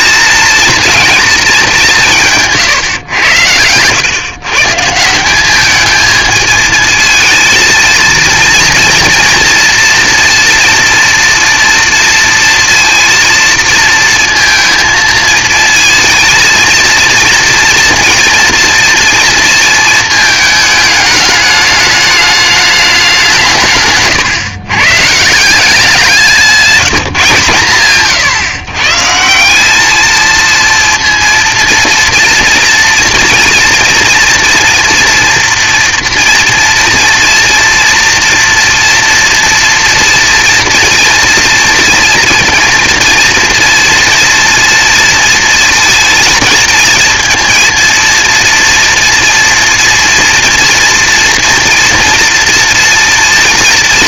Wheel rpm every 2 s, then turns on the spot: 220, 130, 150, 220, 230, 230, 230, 230, 230, 230, 220, 210, 110, 180, 140, 230, 230, 240, 230, 240, 240, 230, 230, 220, 230, 230, 230.
none